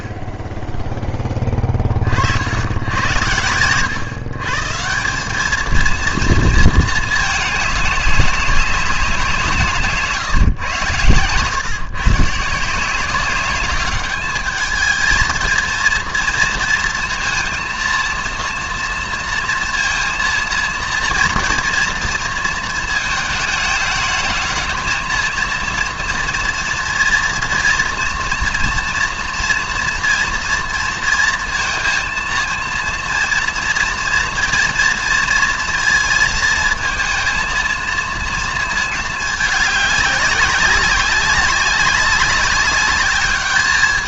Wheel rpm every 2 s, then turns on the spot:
10, 80, 160, 220, 200, 130, 160, 210, 230, 230, 230, 230, 220, 230, 240, 230, 230, 230, 230, 220, 200, 200.
none